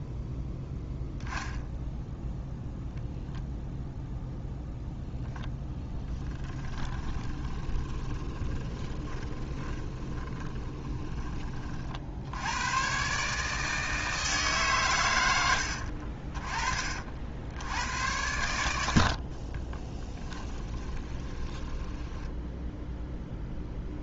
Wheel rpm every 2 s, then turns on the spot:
0, 0, 0, 20, 30, 20, 120, 130, 40, 80, 20, 0.
6-12 18-22